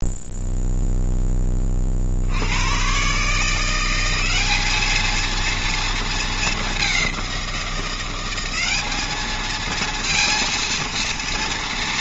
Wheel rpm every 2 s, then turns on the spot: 0, 120, 220, 200, 200, 230.
none